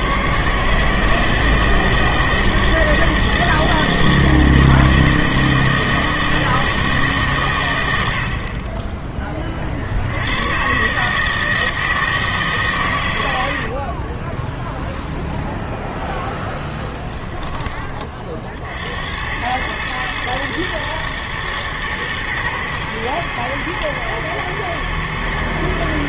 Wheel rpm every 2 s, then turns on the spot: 150, 160, 160, 160, 30, 120, 130, 0, 0, 60, 110, 110, 110.
none